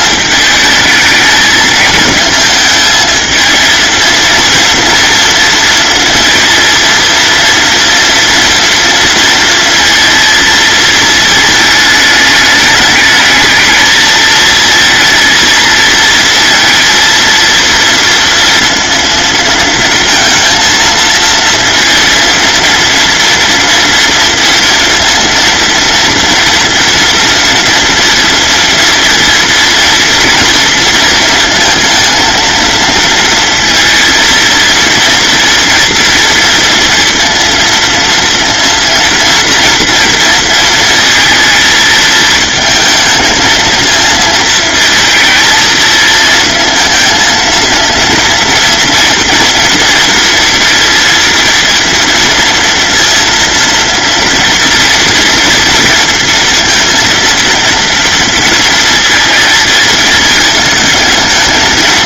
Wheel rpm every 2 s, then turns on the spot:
220, 220, 230, 230, 230, 220, 220, 230, 230, 230, 230, 230, 230, 240, 230, 230, 230, 230, 230, 230, 230, 220, 220, 230, 240, 230, 230, 230, 230, 230, 220.
none